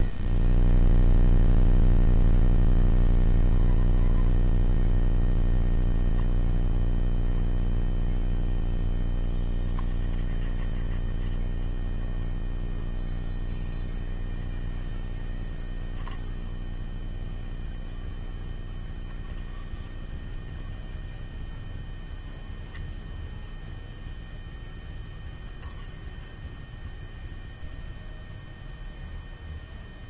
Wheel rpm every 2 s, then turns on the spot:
0, 0, 30, 10, 0, 10, 10, 0, 20, 0, 20, 0, 0, 0, 0.
10-12